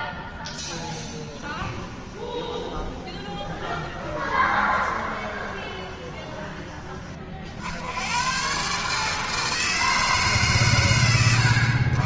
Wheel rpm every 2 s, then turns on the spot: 10, 20, 20, 40, 160, 90.
0-6